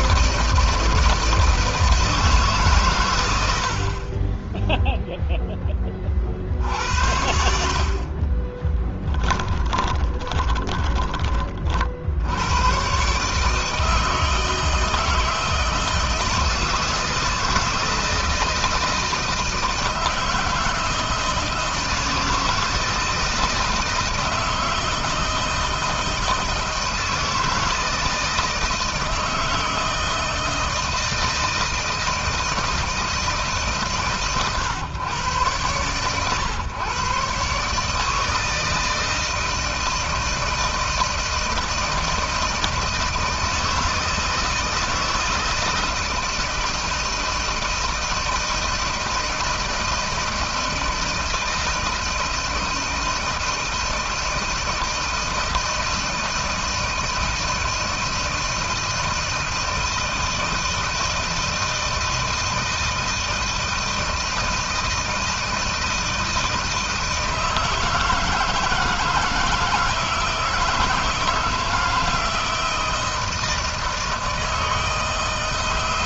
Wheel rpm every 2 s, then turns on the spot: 160, 130, 0, 70, 10, 20, 120, 160, 160, 160, 160, 160, 160, 160, 160, 160, 160, 130, 130, 160, 160, 160, 160, 160, 160, 160, 160, 160, 160, 160, 160, 160, 160, 160, 160, 160, 160, 160.
8-12